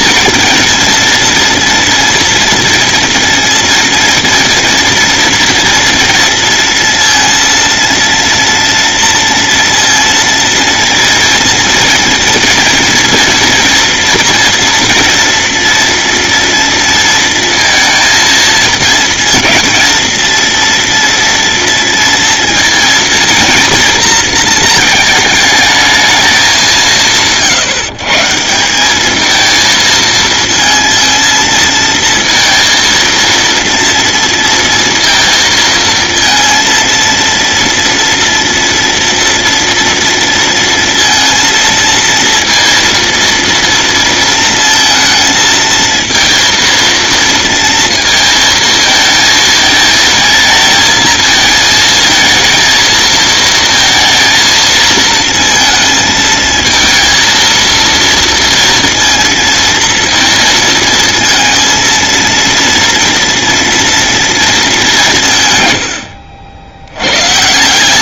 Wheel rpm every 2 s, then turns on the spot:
230, 230, 230, 230, 230, 230, 230, 240, 230, 230, 240, 230, 220, 170, 200, 230, 230, 230, 230, 230, 230, 230, 230, 230, 230, 220, 230, 220, 220, 230, 230, 230, 190, 100.
none